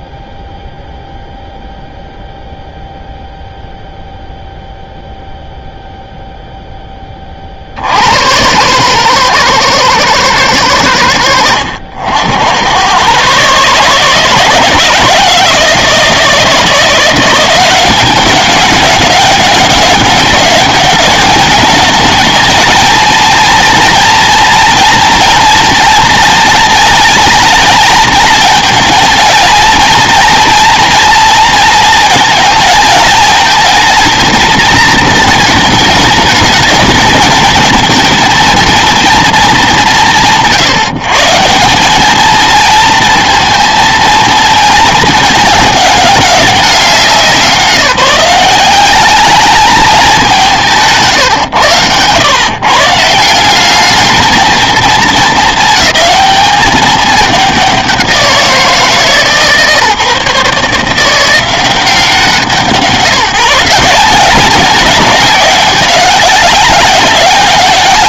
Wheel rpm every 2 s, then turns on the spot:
0, 0, 0, 10, 110, 100, 120, 170, 170, 200, 210, 220, 230, 220, 220, 230, 230, 220, 210, 230, 130, 220, 220, 190, 200, 160, 150, 230, 210, 160, 150, 170, 190, 200.
none